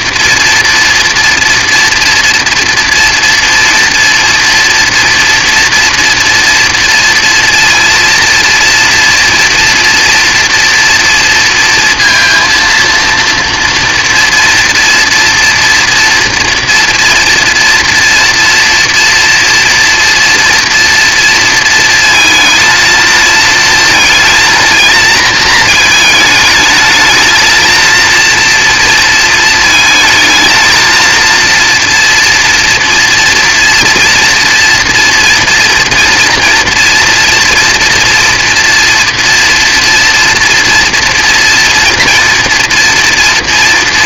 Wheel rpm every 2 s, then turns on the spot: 240, 230, 240, 230, 230, 230, 230, 230, 230, 230, 240, 230, 230, 220, 230, 230, 230, 230, 230, 230, 230, 230.
none